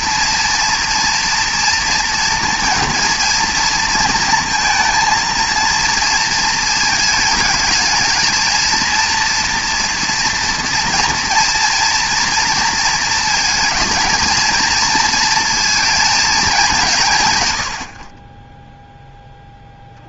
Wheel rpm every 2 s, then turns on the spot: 230, 230, 230, 220, 230, 230, 230, 220, 200, 10.
none